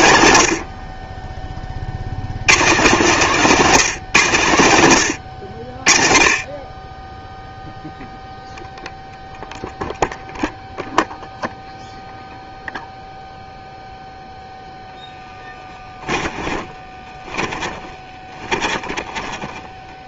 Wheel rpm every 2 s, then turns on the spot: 70, 130, 110, 30, 0, 0, 0, 0, 20, 20.
16-20